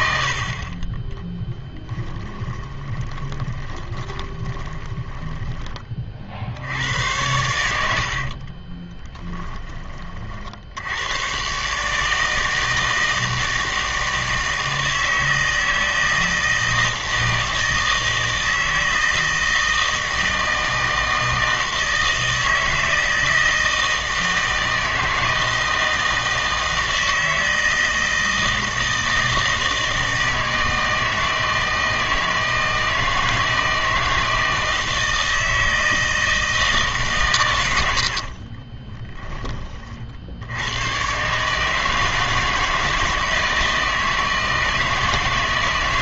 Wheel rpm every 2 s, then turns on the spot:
40, 20, 20, 70, 20, 80, 160, 160, 160, 160, 160, 160, 160, 160, 160, 160, 160, 160, 160, 30, 80, 160, 160.
0-6 8-10 38-40